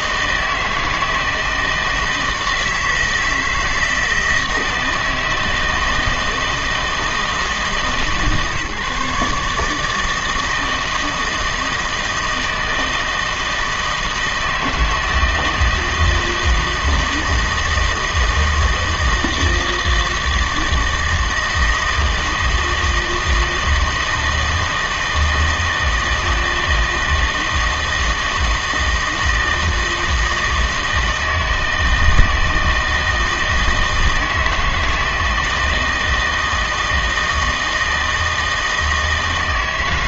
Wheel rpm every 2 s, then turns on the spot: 160, 160, 160, 160, 150, 160, 160, 160, 160, 160, 160, 160, 160, 160, 160, 160, 160, 160, 160, 160.
none